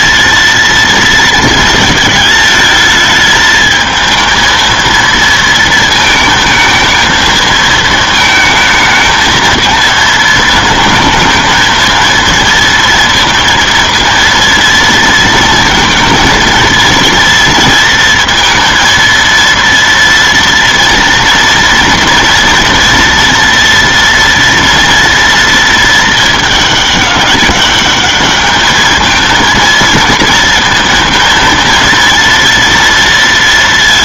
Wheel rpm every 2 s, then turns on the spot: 230, 220, 220, 220, 220, 220, 230, 230, 230, 230, 230, 230, 230, 210, 210, 230, 230.
none